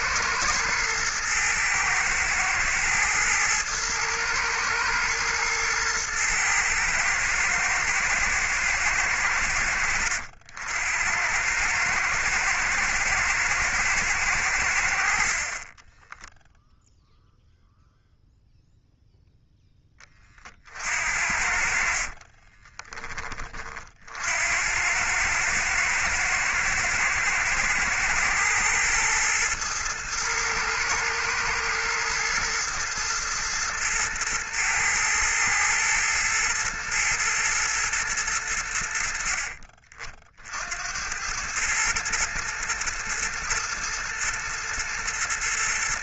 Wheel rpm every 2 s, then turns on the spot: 120, 110, 110, 120, 110, 90, 110, 70, 0, 0, 50, 20, 90, 110, 120, 110, 120, 110, 120, 80, 80, 120, 110.
none